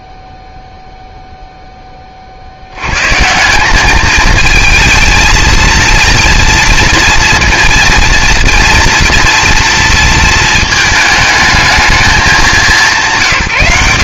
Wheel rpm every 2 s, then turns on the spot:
0, 80, 220, 240, 230, 220, 200.
none